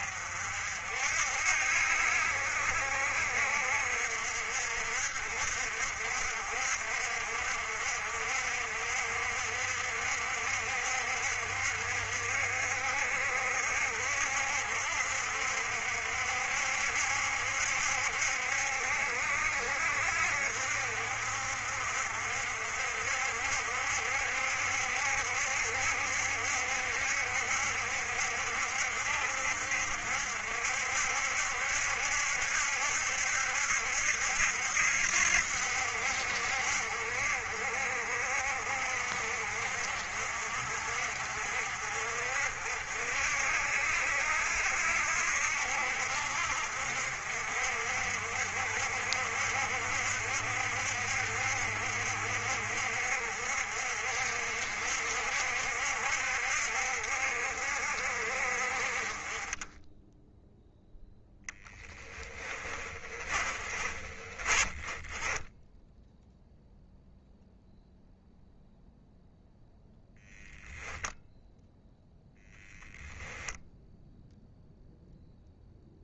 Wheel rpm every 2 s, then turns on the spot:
60, 60, 60, 60, 60, 60, 60, 60, 70, 60, 60, 60, 70, 60, 60, 70, 70, 70, 60, 50, 60, 60, 60, 60, 60, 60, 60, 60, 60, 40, 0, 30, 20, 0, 0, 0, 0, 0.
62-66